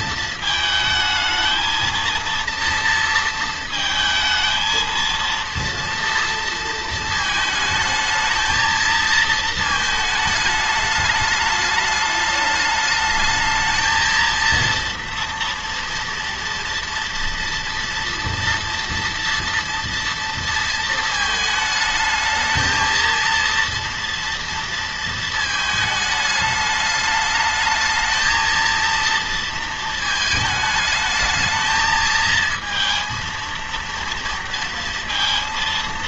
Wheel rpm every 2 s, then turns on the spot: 220, 230, 220, 230, 220, 220, 210, 230, 240, 230, 230, 220, 230, 210, 220, 220, 230, 230.
none